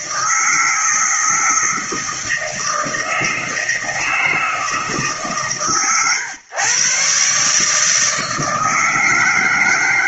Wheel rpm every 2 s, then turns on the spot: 160, 160, 150, 130, 160.
none